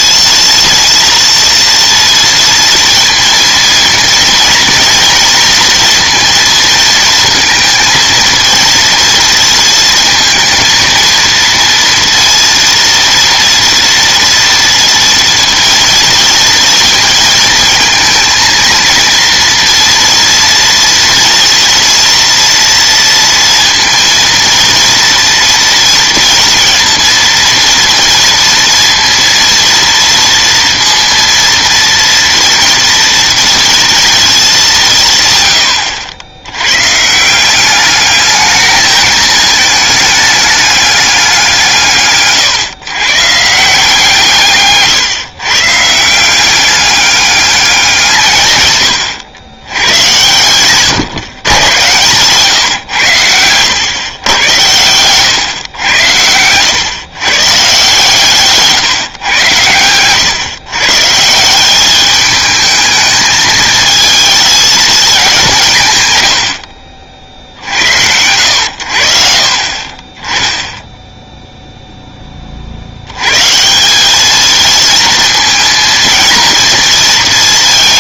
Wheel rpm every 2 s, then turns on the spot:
230, 230, 230, 230, 230, 230, 230, 230, 230, 230, 230, 230, 230, 230, 230, 230, 230, 200, 110, 210, 210, 130, 150, 190, 120, 130, 120, 100, 110, 140, 130, 220, 220, 70, 90, 10, 50, 220, 230.
none